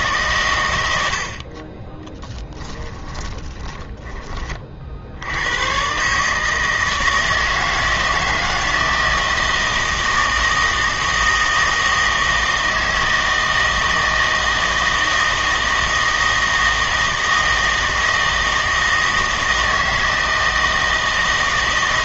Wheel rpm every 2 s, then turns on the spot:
120, 10, 30, 160, 160, 160, 160, 160, 160, 160, 160.
2-4